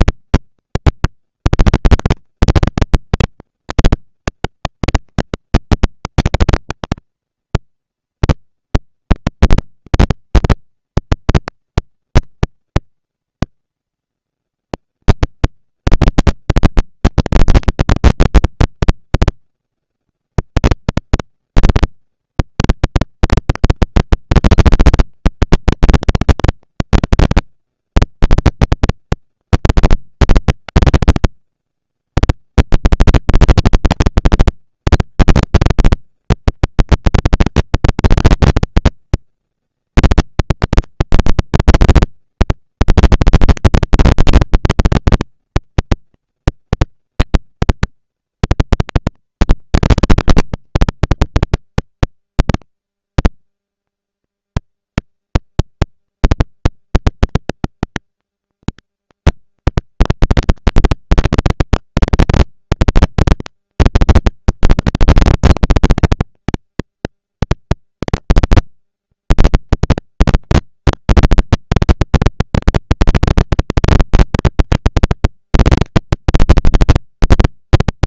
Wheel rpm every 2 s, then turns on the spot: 230, 230, 240, 230, 230, 230, 230, 230, 230, 230, 230, 230, 230, 220, 200, 140, 170, 230, 220, 230, 230, 230, 230, 230, 230, 240, 220, 210, 220, 230, 230, 230, 230, 230, 230, 230, 230, 230, 220.
none